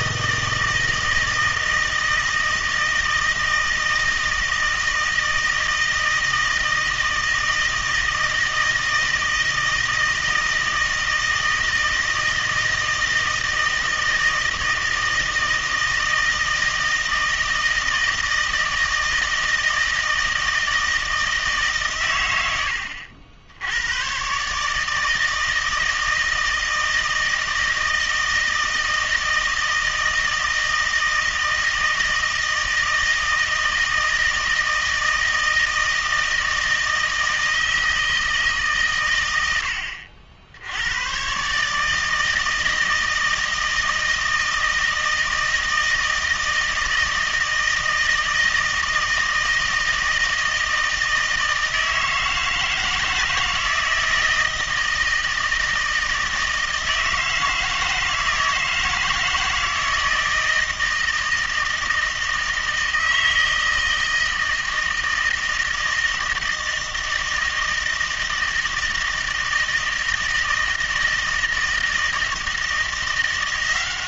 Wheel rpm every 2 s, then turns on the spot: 160, 160, 160, 160, 160, 160, 160, 160, 160, 160, 160, 90, 150, 160, 160, 160, 160, 160, 160, 140, 90, 160, 160, 160, 160, 160, 160, 160, 160, 160, 160, 160, 160, 160, 160, 160, 170.
none